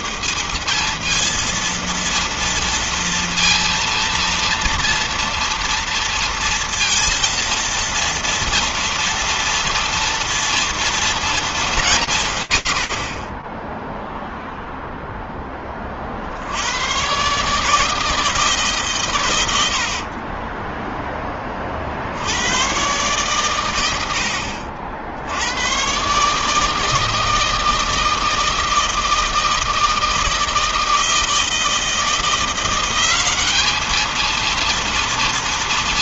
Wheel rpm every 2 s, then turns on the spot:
220, 230, 230, 230, 230, 230, 40, 10, 130, 120, 10, 120, 70, 160, 160, 160, 190, 230.
none